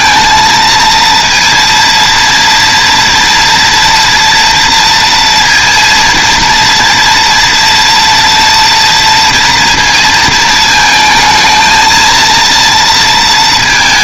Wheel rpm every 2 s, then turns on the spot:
230, 230, 240, 230, 230, 220, 230.
none